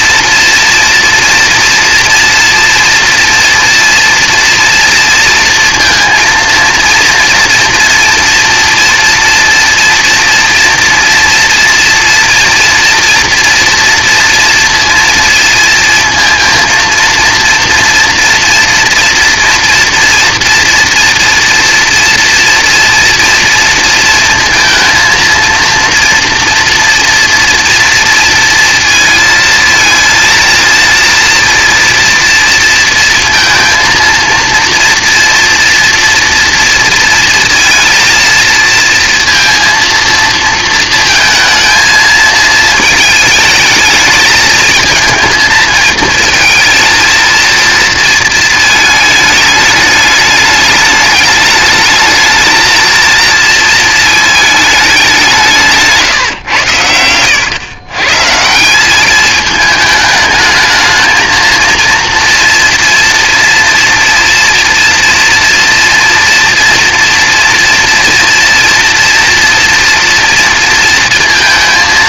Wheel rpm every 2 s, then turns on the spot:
230, 230, 230, 230, 240, 230, 230, 230, 230, 230, 230, 240, 230, 230, 220, 230, 230, 230, 230, 230, 230, 220, 230, 230, 220, 210, 230, 210, 100, 190, 220, 230, 230, 230, 240, 230.
56-58